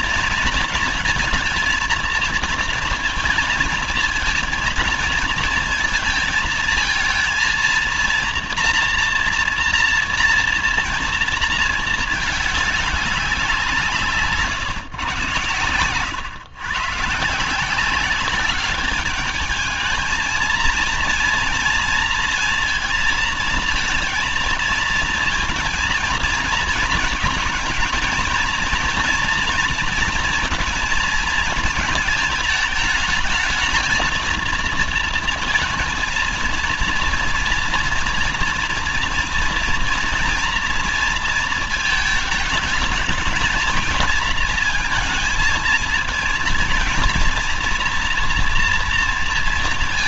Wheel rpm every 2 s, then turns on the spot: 230, 230, 220, 220, 230, 230, 210, 150, 130, 200, 220, 230, 230, 230, 230, 230, 220, 230, 230, 230, 230, 220, 230, 230, 240.
none